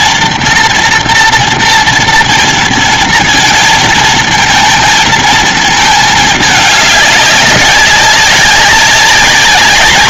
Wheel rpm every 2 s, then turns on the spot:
230, 240, 230, 220, 200.
none